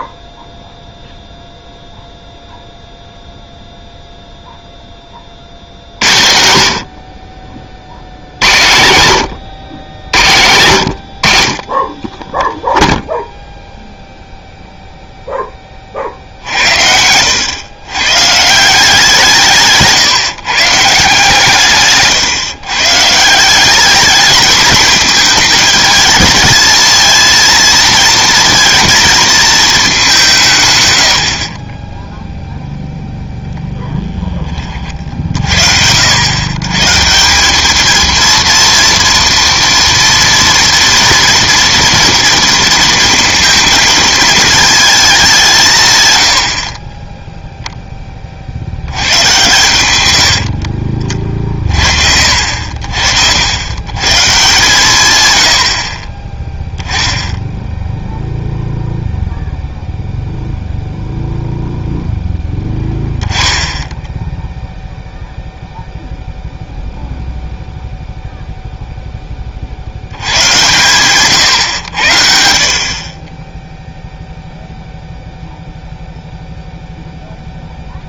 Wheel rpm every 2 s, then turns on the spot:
0, 0, 0, 70, 90, 100, 0, 0, 60, 160, 150, 130, 210, 220, 230, 140, 0, 20, 120, 230, 230, 230, 220, 60, 50, 60, 70, 160, 10, 0, 0, 10, 0, 0, 0, 100, 50, 0, 0.
50-52